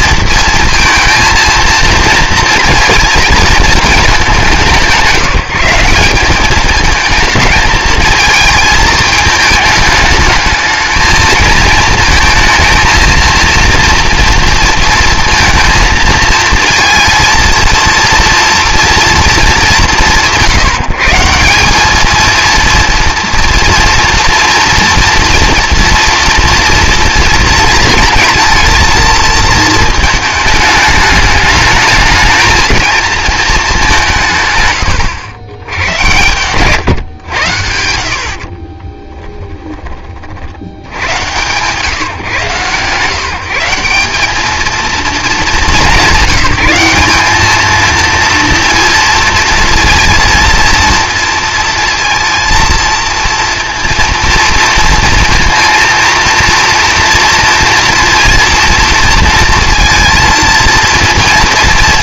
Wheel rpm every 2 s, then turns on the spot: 230, 230, 180, 220, 220, 210, 230, 230, 230, 230, 160, 230, 230, 230, 230, 210, 220, 120, 130, 40, 80, 140, 220, 200, 230, 230, 230, 230, 230, 230, 230.
38-40